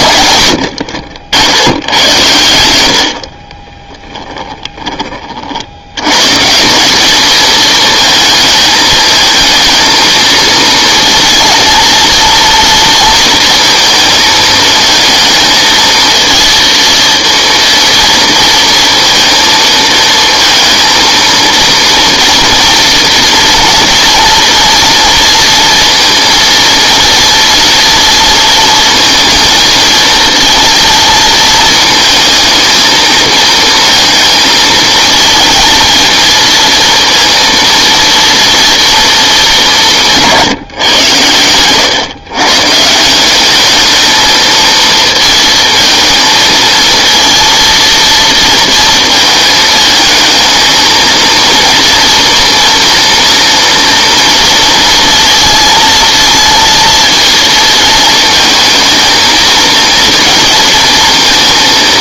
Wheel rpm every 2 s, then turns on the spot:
110, 90, 10, 160, 220, 230, 230, 220, 230, 230, 230, 230, 230, 230, 230, 230, 220, 220, 230, 230, 160, 140, 230, 230, 230, 220, 230, 230, 230, 220, 230.
none